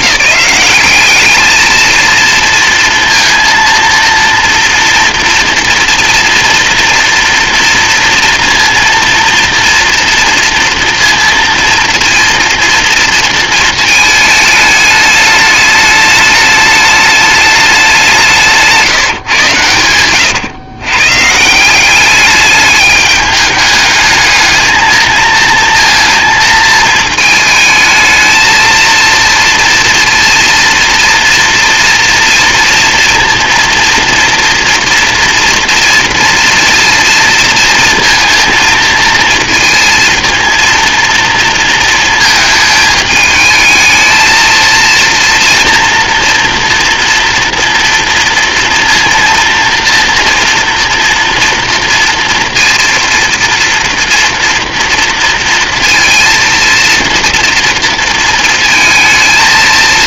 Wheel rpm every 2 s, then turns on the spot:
200, 230, 230, 230, 230, 230, 230, 210, 210, 170, 120, 210, 220, 220, 220, 230, 230, 230, 230, 230, 230, 220, 230, 230, 230, 230, 230, 230, 230, 230.
none